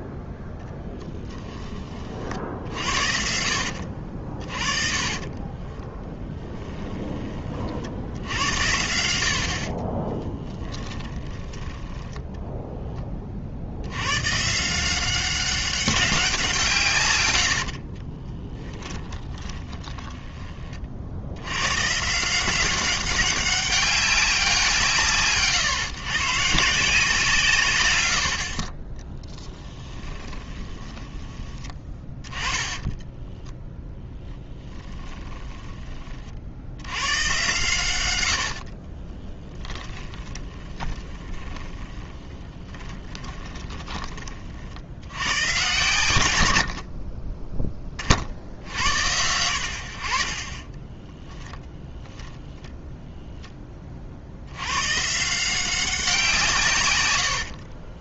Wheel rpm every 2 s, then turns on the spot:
0, 70, 40, 10, 70, 10, 10, 160, 160, 10, 30, 190, 170, 160, 40, 20, 20, 10, 80, 50, 20, 30, 60, 60, 80, 20, 30, 100, 140.
4-8 10-12 18-20 30-36 38-44